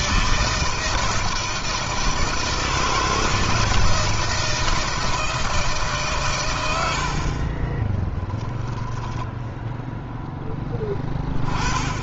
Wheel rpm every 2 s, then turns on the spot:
160, 160, 160, 90, 10, 10.
none